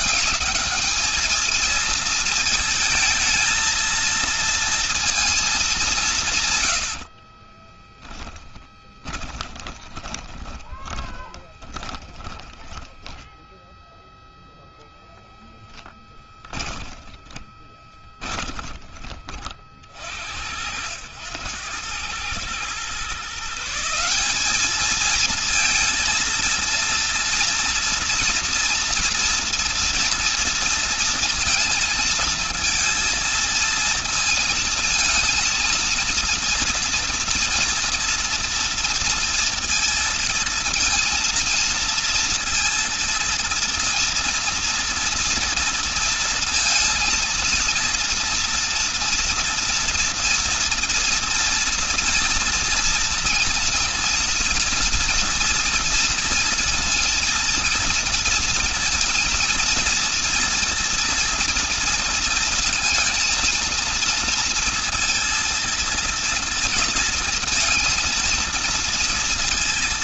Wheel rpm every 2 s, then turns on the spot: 210, 220, 230, 50, 20, 20, 10, 10, 20, 30, 90, 140, 220, 230, 230, 230, 230, 230, 230, 230, 230, 230, 230, 230, 230, 230, 230, 230, 230, 230, 230, 230, 230, 230, 220.
6-14 16-18